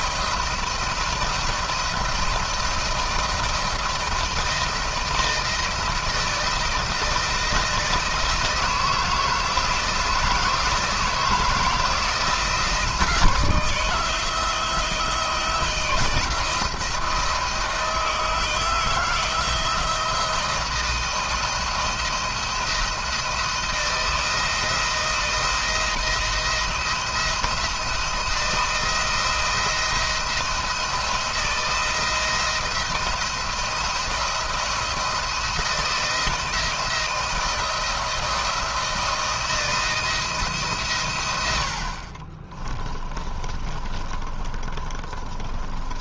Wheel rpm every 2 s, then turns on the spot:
170, 170, 160, 160, 160, 160, 160, 160, 170, 160, 160, 170, 170, 170, 160, 170, 170, 170, 160, 160, 140, 30, 30.
42-46